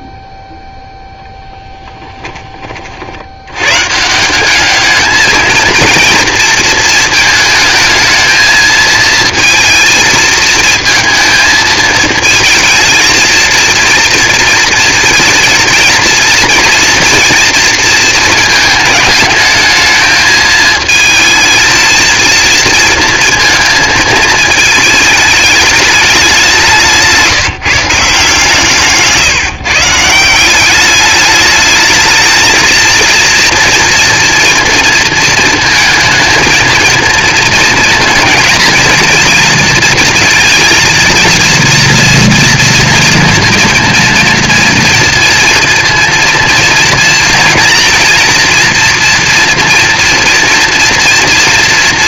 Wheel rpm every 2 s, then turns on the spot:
0, 30, 200, 230, 220, 230, 220, 230, 230, 220, 220, 230, 220, 170, 150, 190, 230, 230, 220, 220, 230, 230, 230, 230, 230, 230.
none